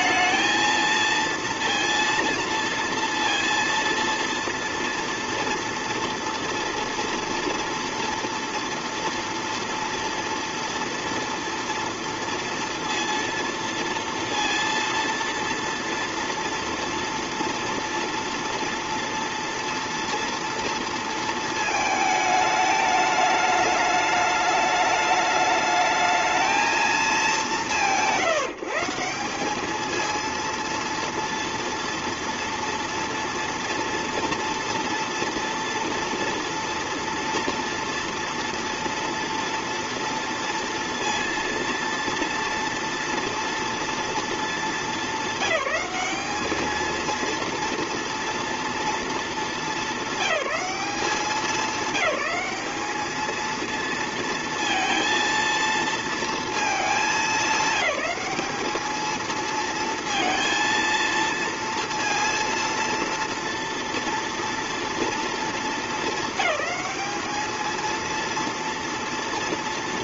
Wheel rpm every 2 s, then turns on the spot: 230, 230, 230, 230, 230, 230, 230, 230, 230, 230, 230, 210, 210, 220, 170, 230, 230, 230, 230, 230, 230, 240, 230, 220, 230, 200, 210, 230, 220, 210, 230, 230, 230, 200, 240.
none